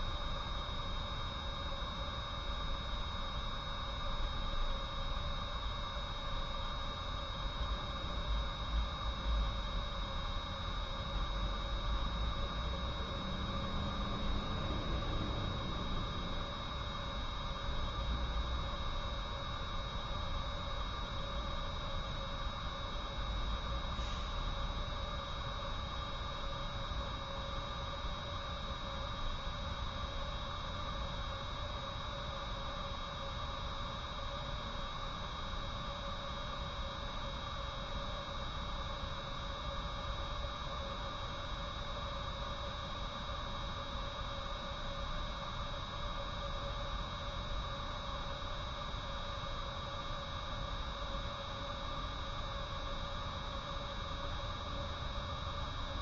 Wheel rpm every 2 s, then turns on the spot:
0, 0, 0, 0, 0, 0, 0, 0, 0, 0, 0, 0, 0, 0, 0, 0, 0, 0, 0, 0, 0, 0, 0, 0, 0, 0, 0, 0.
none